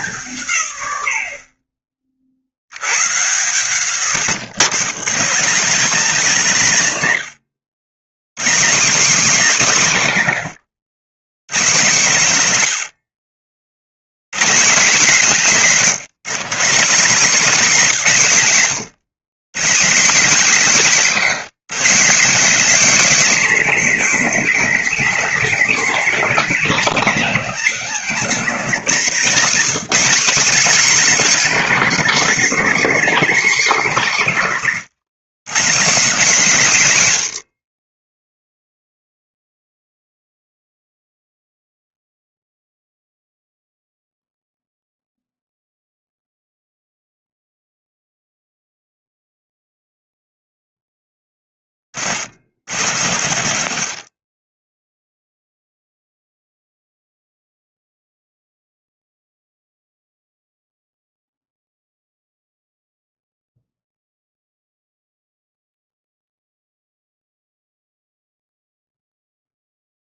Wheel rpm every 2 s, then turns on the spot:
90, 100, 160, 160, 230, 120, 100, 220, 200, 170, 260, 300, 300, 240, 220, 270, 270, 170, 130, 0, 0, 0, 0, 0, 0, 10, 70, 0, 0, 0, 0, 0, 0, 0, 0.
52-54